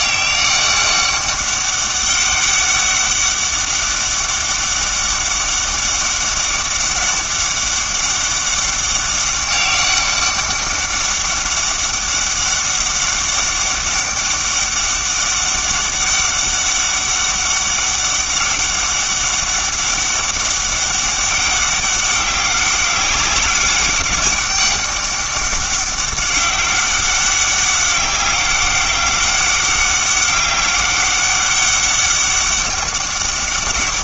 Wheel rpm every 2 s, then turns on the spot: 200, 200, 200, 200, 200, 200, 200, 200, 200, 200, 200, 200, 200, 200, 190, 200, 200.
none